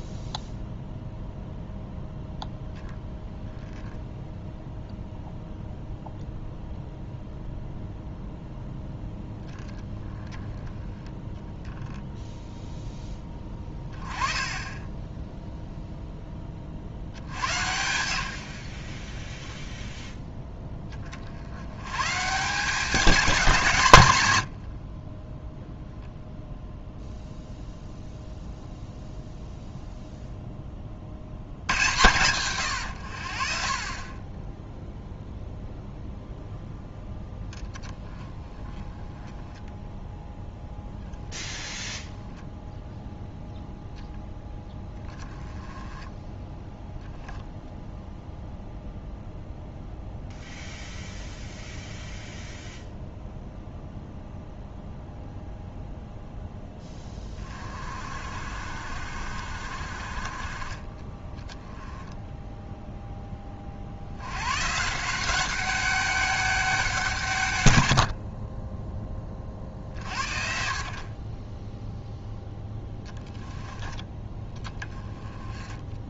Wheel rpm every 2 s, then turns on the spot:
0, 0, 0, 0, 0, 10, 10, 20, 60, 50, 20, 190, 60, 0, 0, 40, 100, 0, 0, 10, 0, 0, 10, 0, 0, 0, 0, 0, 10, 50, 20, 0, 160, 180, 10, 50, 10, 10.
none